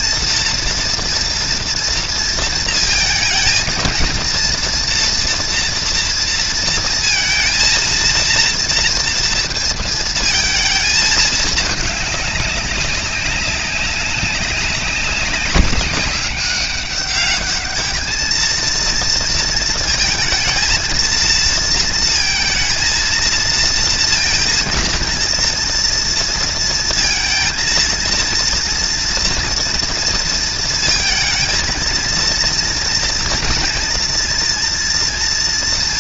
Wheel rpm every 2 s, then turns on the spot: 230, 220, 230, 230, 230, 220, 200, 190, 200, 230, 230, 230, 230, 230, 230, 230, 230, 230.
none